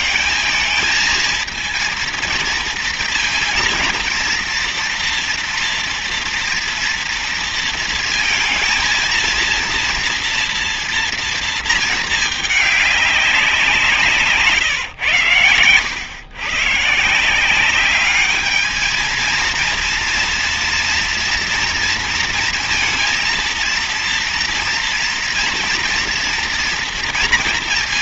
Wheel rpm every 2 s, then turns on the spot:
220, 230, 230, 230, 230, 230, 210, 160, 130, 210, 240, 230, 230, 230.
none